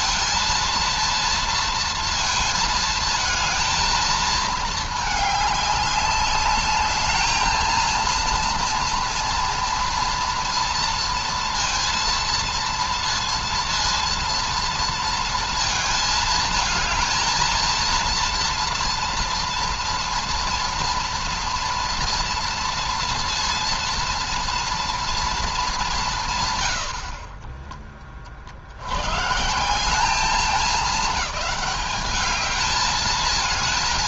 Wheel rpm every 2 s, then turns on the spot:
230, 220, 210, 210, 230, 230, 230, 230, 220, 230, 230, 230, 230, 80, 100, 210, 220.
none